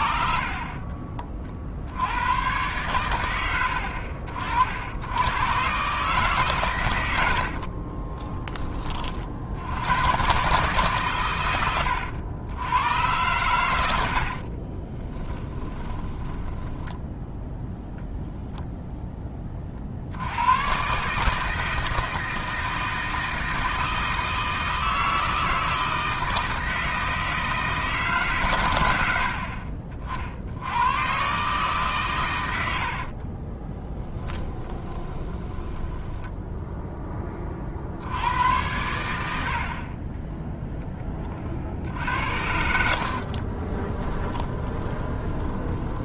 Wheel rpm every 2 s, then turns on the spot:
40, 100, 70, 130, 30, 140, 100, 40, 10, 0, 110, 160, 160, 160, 110, 90, 90, 10, 0, 80, 10, 70, 20.
0-2 14-18 34-36 42-46